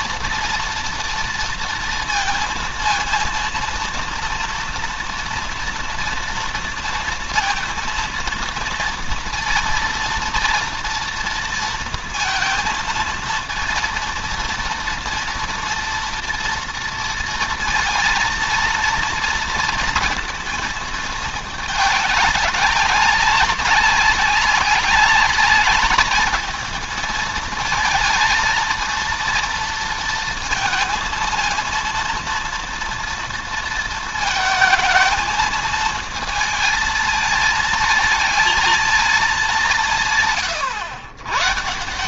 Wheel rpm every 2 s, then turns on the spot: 230, 230, 230, 230, 230, 230, 230, 230, 230, 230, 220, 200, 200, 220, 230, 220, 230, 220, 230, 220, 110.
none